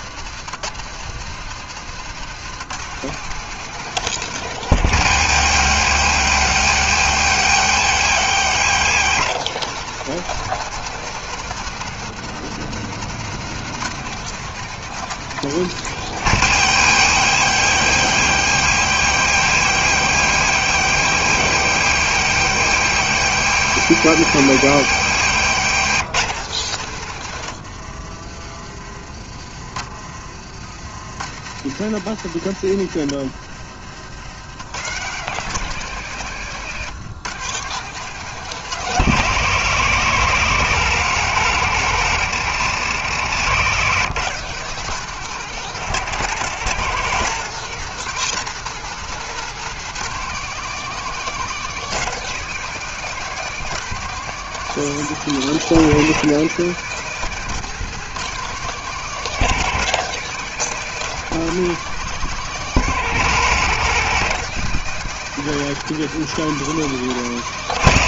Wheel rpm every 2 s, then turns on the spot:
150, 170, 160, 130, 160, 170, 160, 170, 140, 140, 140, 140, 130, 130, 30, 80, 100, 140, 140, 160, 150, 150, 170, 170, 170, 180, 180, 170, 170, 170, 170, 170, 170, 170.
26-28